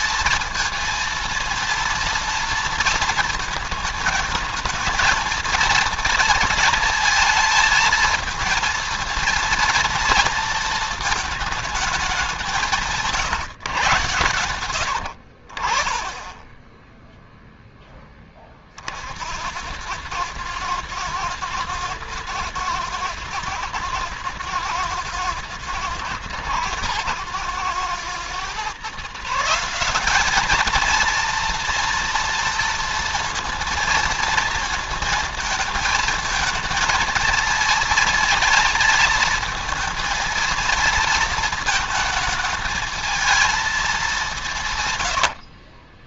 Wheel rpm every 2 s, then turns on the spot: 230, 230, 220, 230, 230, 230, 180, 90, 10, 40, 110, 120, 110, 110, 130, 220, 230, 230, 220, 220, 220, 220, 160.
44-46